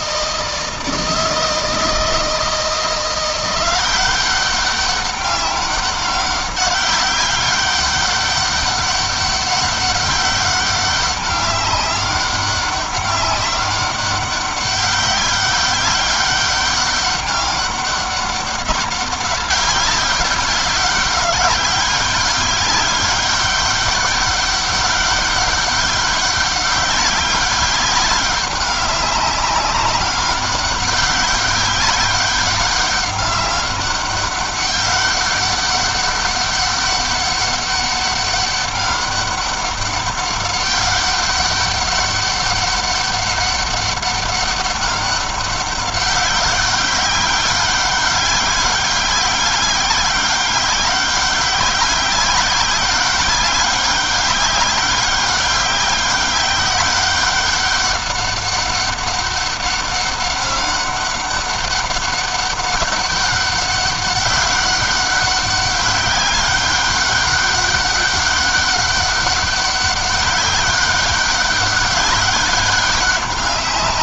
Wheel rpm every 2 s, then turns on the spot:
160, 170, 190, 190, 200, 200, 200, 200, 200, 200, 190, 200, 200, 200, 200, 190, 200, 200, 200, 200, 200, 200, 200, 190, 200, 190, 200, 190, 190, 200, 190, 190, 190, 200, 200, 200, 200.
none